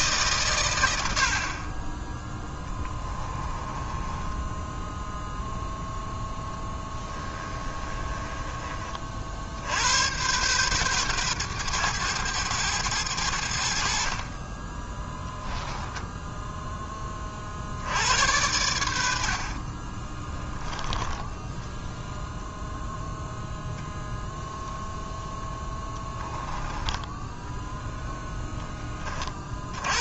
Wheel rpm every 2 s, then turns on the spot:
90, 20, 0, 10, 40, 120, 100, 10, 20, 80, 10, 0, 0, 10, 20.
6-8 14-16 20-22